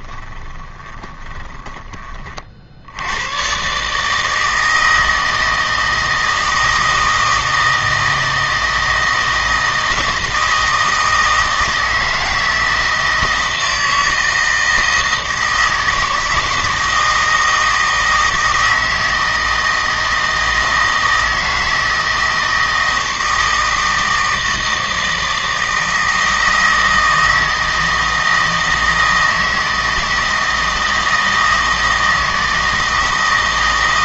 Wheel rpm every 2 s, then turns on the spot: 20, 70, 160, 160, 160, 160, 160, 160, 160, 160, 160, 160, 160, 160, 160, 160, 160.
0-2